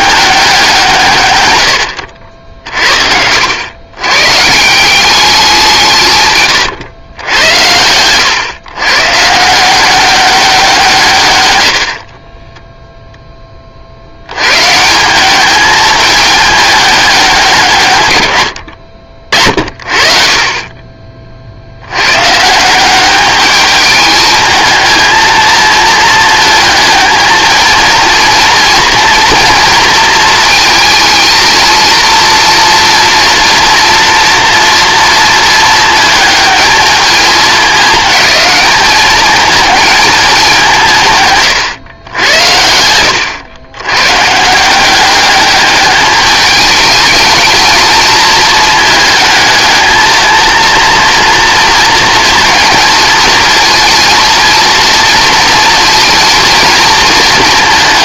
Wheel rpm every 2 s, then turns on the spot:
170, 60, 180, 110, 120, 170, 0, 150, 200, 60, 30, 180, 230, 230, 230, 230, 230, 230, 220, 210, 180, 80, 180, 210, 220, 230, 230, 230, 230.
none